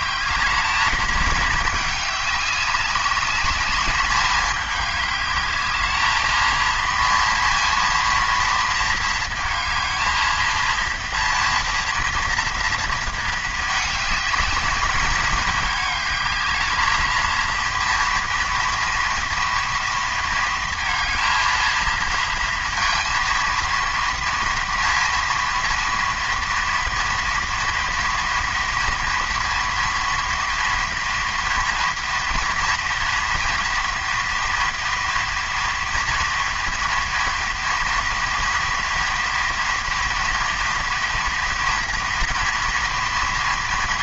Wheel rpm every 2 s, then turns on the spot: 200, 210, 220, 230, 230, 230, 210, 220, 230, 230, 230, 230, 230, 230, 230, 230, 230, 230, 240, 230, 230, 230.
none